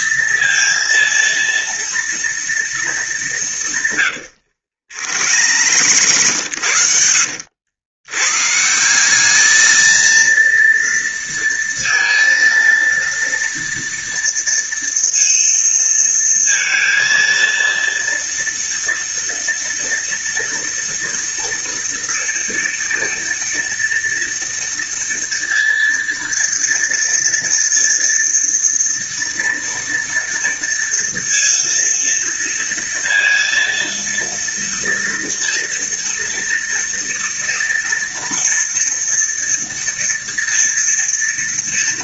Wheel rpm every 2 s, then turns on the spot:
230, 180, 90, 90, 210, 230, 230, 230, 230, 230, 230, 230, 230, 230, 230, 230, 230, 230, 230, 230, 230.
4-6